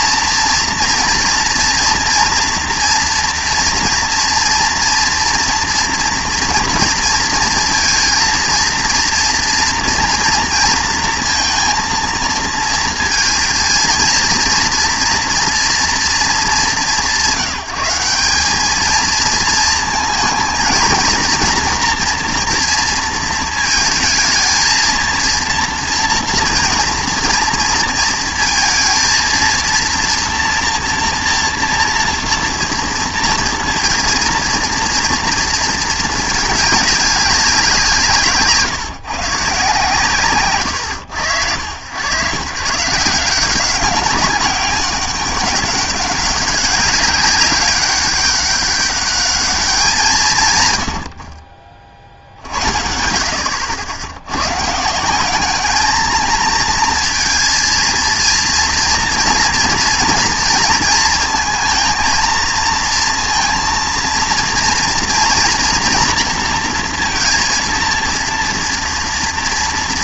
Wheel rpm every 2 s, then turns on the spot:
230, 230, 230, 230, 230, 230, 230, 230, 200, 200, 220, 230, 230, 230, 220, 230, 230, 230, 200, 140, 120, 130, 190, 200, 200, 120, 60, 130, 230, 230, 220, 230, 230, 230, 230.
none